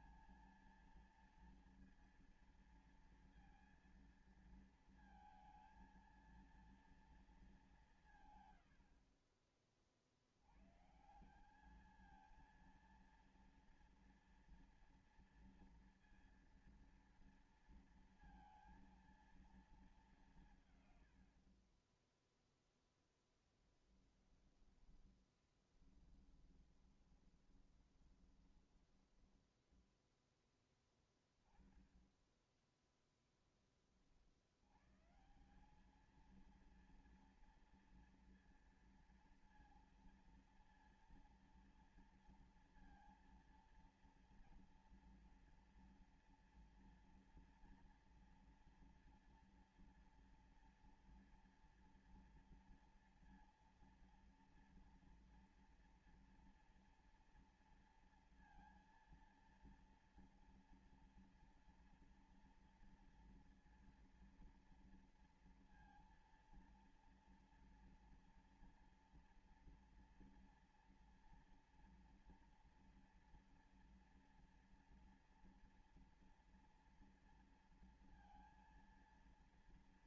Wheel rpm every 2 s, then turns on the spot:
220, 230, 230, 230, 110, 90, 220, 230, 230, 230, 170, 0, 10, 20, 20, 10, 10, 70, 220, 230, 230, 230, 230, 230, 230, 240, 240, 230, 230, 230, 230, 230, 230, 230, 230, 230, 230, 230, 230, 230.
24-30